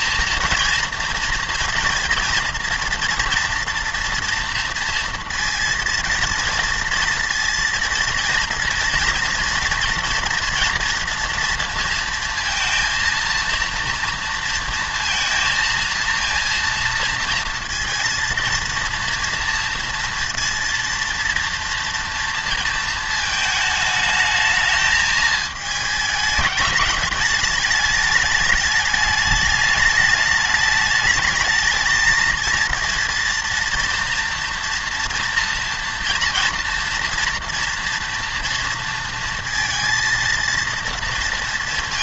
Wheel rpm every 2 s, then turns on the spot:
230, 230, 230, 230, 230, 230, 230, 230, 230, 230, 230, 230, 220, 210, 210, 210, 230, 230, 230, 230, 230.
none